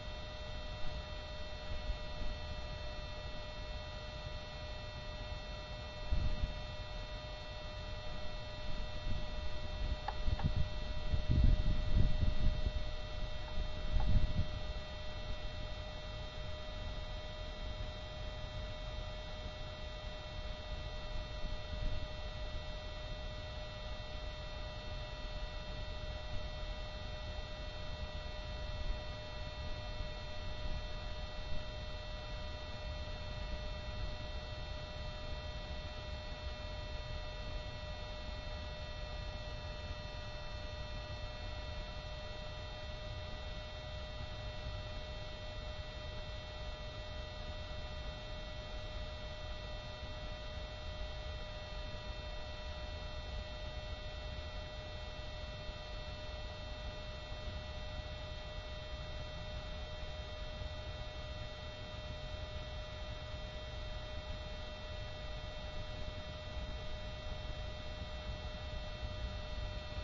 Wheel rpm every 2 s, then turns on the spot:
0, 0, 0, 0, 0, 0, 0, 0, 0, 0, 0, 0, 0, 0, 0, 0, 0, 0, 0, 0, 0, 0, 0, 0, 0, 0, 0, 0, 0, 0, 0, 0, 0, 0, 0.
none